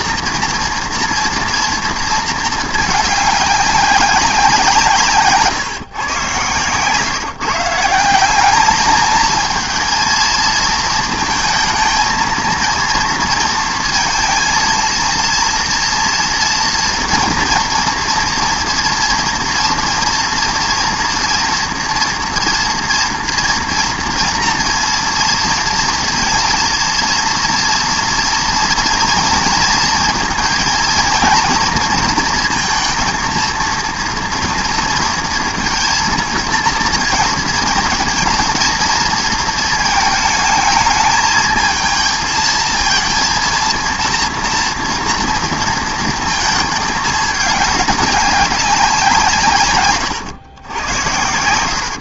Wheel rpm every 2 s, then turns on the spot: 230, 220, 190, 120, 200, 230, 230, 230, 240, 240, 230, 230, 230, 230, 230, 230, 230, 230, 230, 230, 220, 230, 230, 220, 200, 110.
none